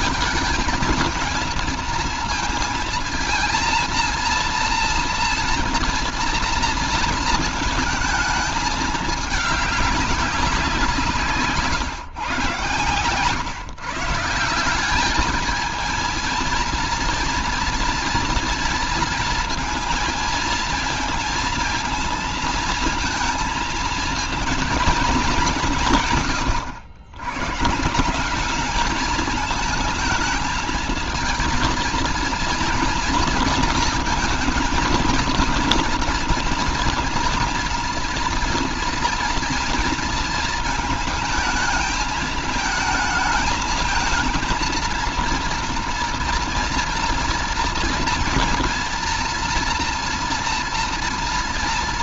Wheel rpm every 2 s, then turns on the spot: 230, 230, 230, 230, 210, 180, 130, 190, 230, 230, 230, 220, 230, 110, 200, 220, 230, 220, 230, 240, 220, 220, 230, 230, 230, 230.
none